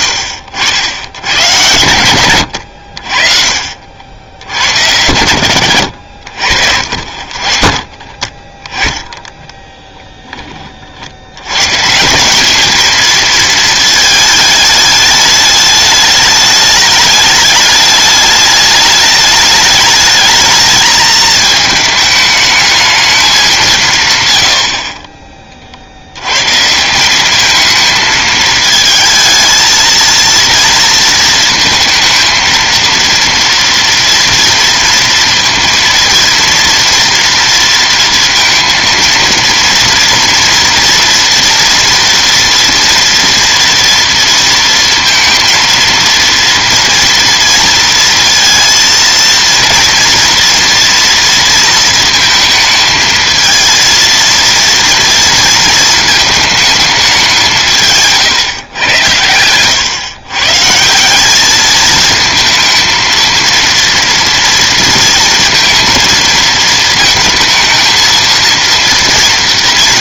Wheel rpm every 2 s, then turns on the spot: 70, 100, 80, 70, 30, 20, 200, 220, 210, 210, 220, 220, 100, 130, 220, 230, 230, 230, 230, 230, 230, 230, 230, 230, 230, 230, 220, 230, 220, 140, 130, 220, 230, 230, 230.
2-4 6-8